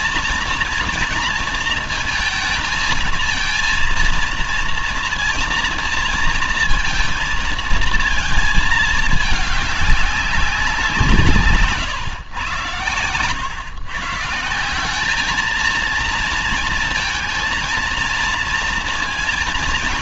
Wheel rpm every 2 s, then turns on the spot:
230, 220, 230, 230, 220, 180, 120, 170, 230, 230.
none